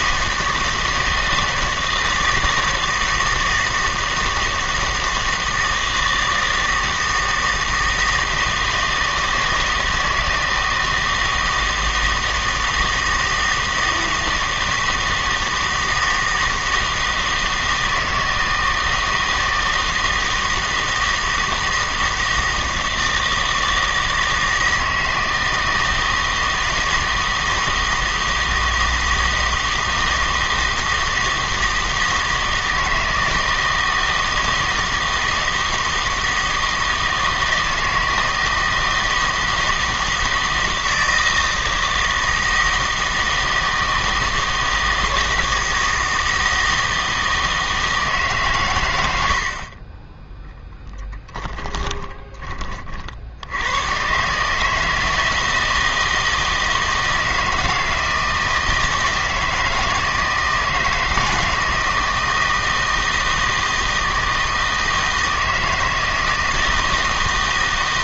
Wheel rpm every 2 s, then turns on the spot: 160, 160, 160, 160, 160, 160, 160, 160, 160, 160, 160, 160, 160, 160, 160, 160, 160, 160, 160, 160, 160, 160, 160, 160, 110, 10, 30, 150, 160, 160, 160, 160, 160, 160.
none